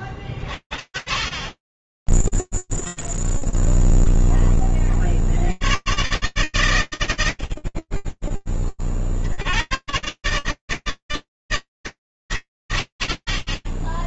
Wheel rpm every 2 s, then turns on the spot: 10, 20, 110, 30, 90, 80, 50.
0-2